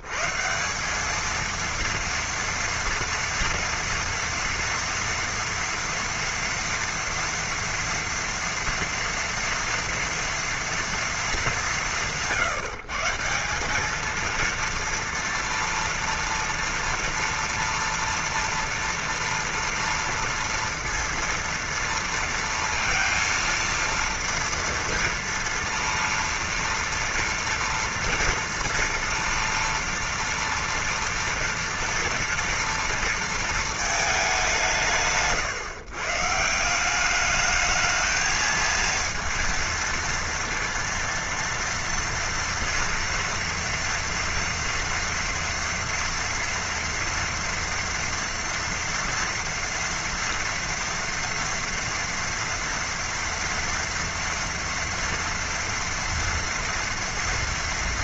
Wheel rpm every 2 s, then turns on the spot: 80, 230, 230, 230, 230, 230, 160, 220, 230, 240, 230, 230, 230, 230, 230, 230, 240, 200, 140, 220, 230, 230, 230, 230, 230, 230, 230, 230, 230.
none